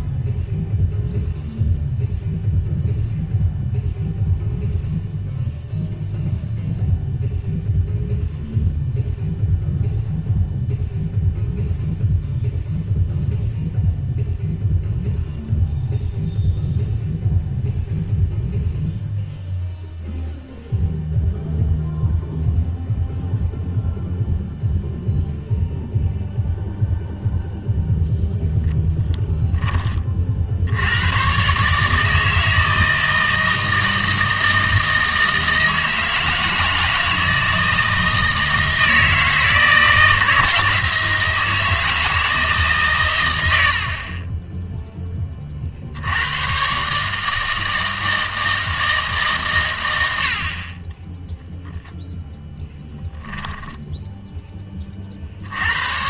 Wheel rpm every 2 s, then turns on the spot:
0, 0, 0, 0, 0, 0, 0, 0, 0, 0, 0, 0, 0, 0, 10, 70, 160, 160, 160, 160, 160, 140, 0, 130, 160, 40, 0, 20.
none